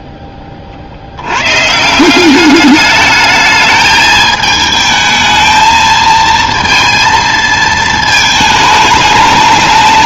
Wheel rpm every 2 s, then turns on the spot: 40, 200, 220, 230, 220.
none